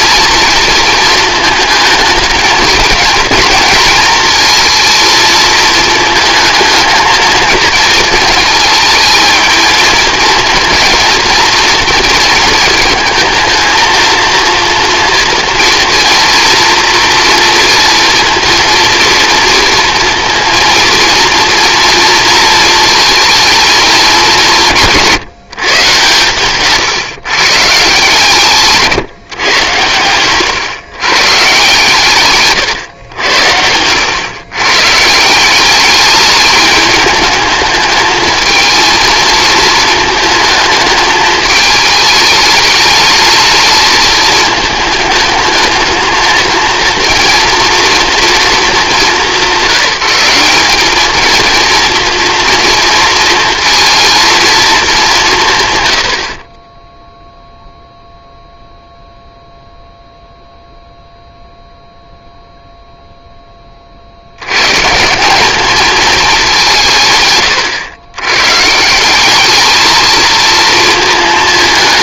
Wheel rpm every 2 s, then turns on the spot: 220, 220, 230, 220, 220, 230, 220, 230, 230, 230, 230, 230, 180, 130, 150, 110, 130, 120, 210, 230, 220, 210, 220, 230, 210, 180, 230, 220, 50, 0, 0, 0, 110, 200, 120, 220.
32-34